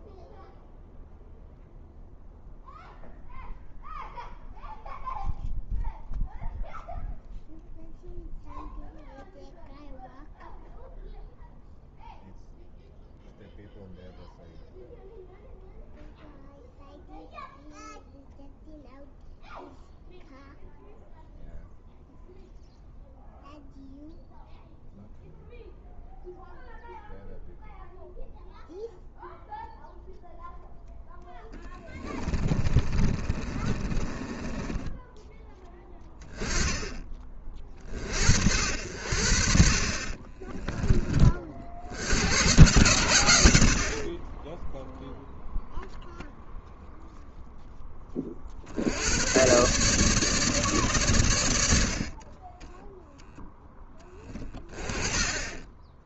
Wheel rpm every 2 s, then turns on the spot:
0, 0, 0, 0, 0, 0, 0, 0, 0, 0, 0, 0, 0, 0, 0, 0, 30, 10, 20, 70, 20, 110, 10, 0, 60, 140, 20, 20.
32-36 40-42 52-54